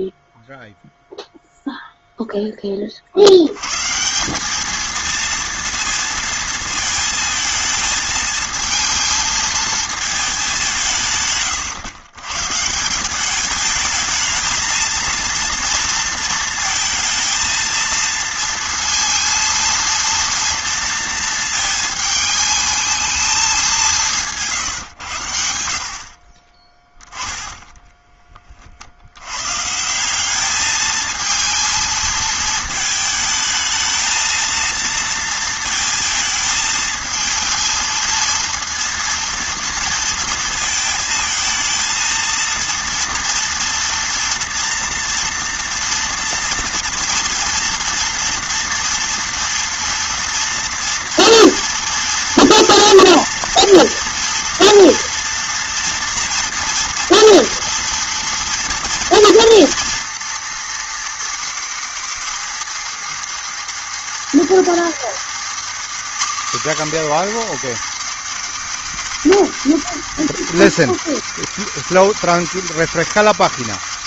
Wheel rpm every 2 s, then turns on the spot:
0, 30, 220, 220, 220, 160, 170, 230, 230, 230, 230, 220, 140, 10, 50, 220, 220, 230, 220, 230, 220, 230, 230, 230, 240, 230, 240, 230, 230, 230, 240, 230, 230, 270, 240, 230, 230.
none